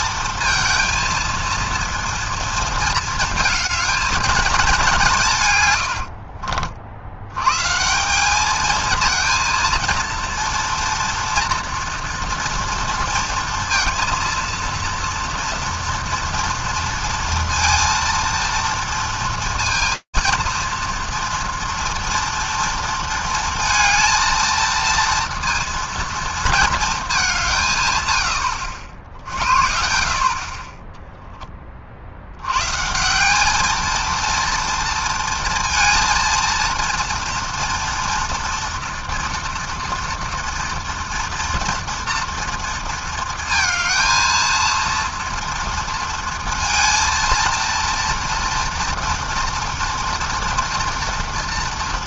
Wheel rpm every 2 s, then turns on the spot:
230, 230, 210, 50, 210, 230, 240, 230, 230, 230, 230, 230, 230, 230, 90, 30, 110, 230, 230, 230, 240, 230, 230, 230, 230, 240.
none